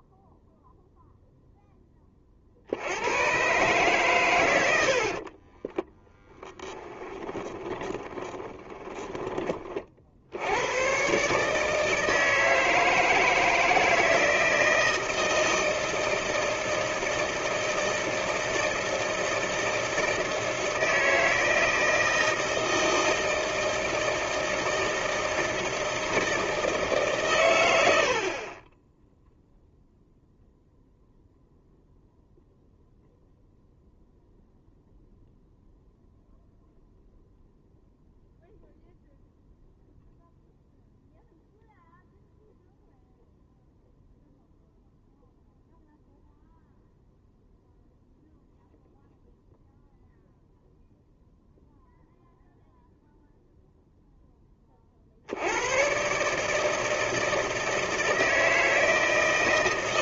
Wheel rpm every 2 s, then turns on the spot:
0, 70, 90, 10, 10, 100, 160, 160, 160, 160, 160, 160, 160, 160, 20, 0, 0, 0, 0, 0, 0, 0, 0, 0, 0, 0, 0, 30, 160, 160.
6-10